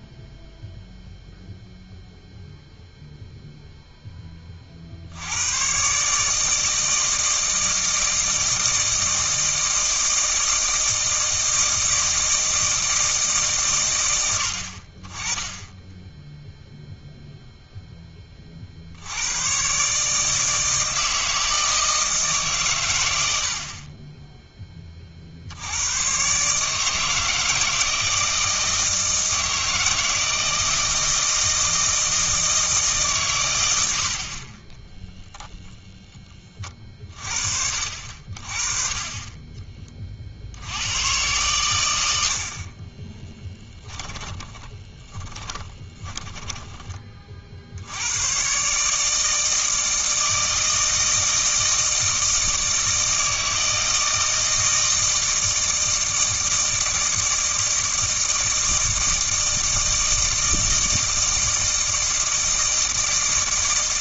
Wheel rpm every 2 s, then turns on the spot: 0, 0, 60, 160, 160, 160, 160, 50, 0, 60, 160, 120, 30, 160, 160, 160, 150, 10, 30, 30, 90, 40, 20, 20, 150, 160, 160, 160, 160, 160, 160, 160.
42-46